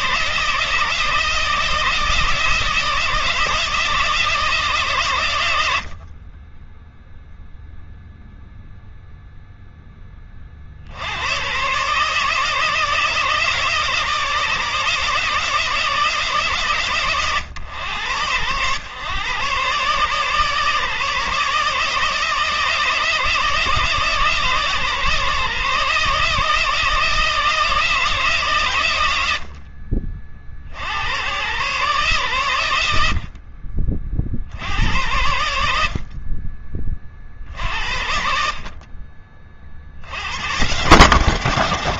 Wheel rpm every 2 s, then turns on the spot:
160, 160, 120, 0, 0, 90, 160, 160, 130, 120, 150, 160, 150, 160, 90, 90, 70, 90, 40, 40, 130.
none